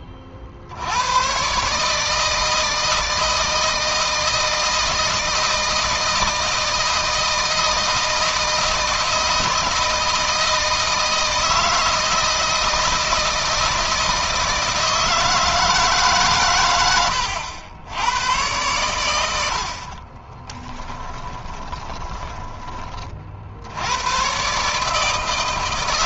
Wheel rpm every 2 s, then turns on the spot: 50, 160, 160, 160, 160, 160, 160, 160, 110, 100, 20, 30, 150.
20-22